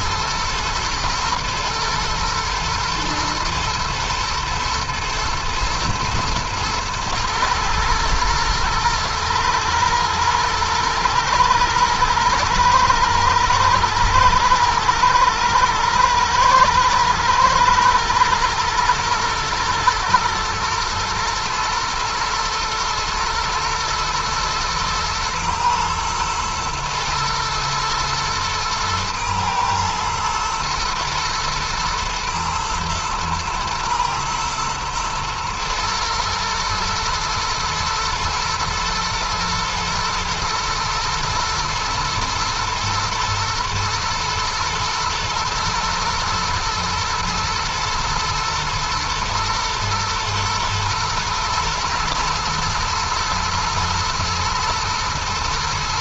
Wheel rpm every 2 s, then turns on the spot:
120, 120, 110, 110, 110, 120, 110, 110, 110, 120, 110, 120, 120, 110, 110, 110, 110, 120, 110, 120, 120, 110, 110, 110, 110, 120, 110, 110.
none